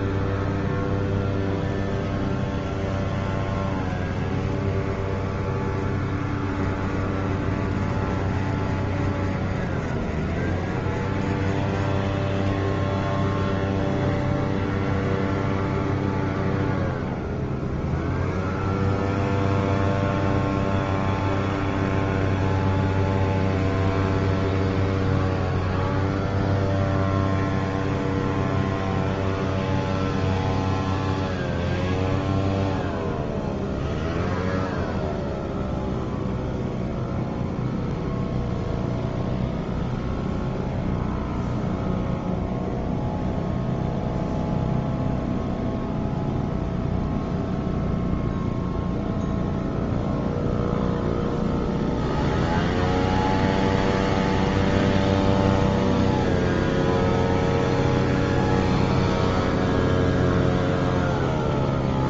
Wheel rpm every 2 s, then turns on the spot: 0, 10, 20, 30, 30, 30, 10, 0, 0, 0, 0, 0, 0, 0, 0, 0, 0, 0, 0, 0, 0, 0, 0, 0, 0, 0, 0, 10, 10, 10, 10.
none